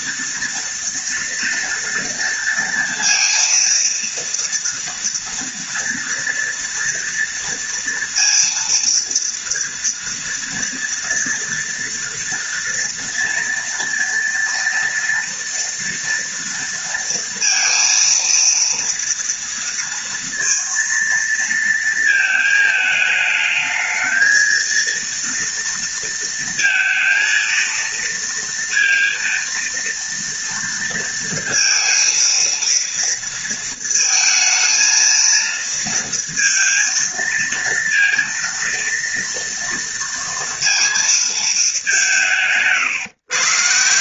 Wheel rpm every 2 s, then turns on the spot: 230, 230, 230, 240, 230, 230, 230, 230, 230, 230, 230, 220, 230, 230, 230, 230, 230, 230, 230, 230, 230, 140.
none